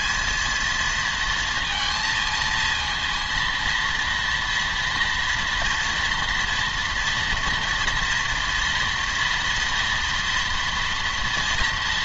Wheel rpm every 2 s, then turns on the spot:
220, 220, 230, 230, 230, 230.
none